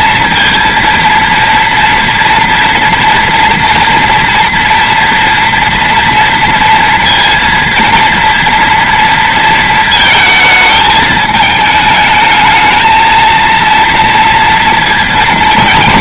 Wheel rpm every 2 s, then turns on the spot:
230, 230, 230, 230, 230, 220, 230, 220.
none